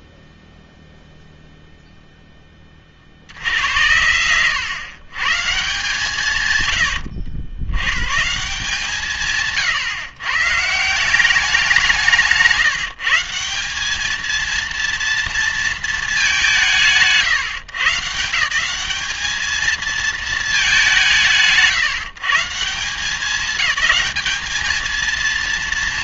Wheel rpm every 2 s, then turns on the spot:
0, 20, 110, 110, 180, 140, 160, 230, 170, 190, 210, 160, 220.
none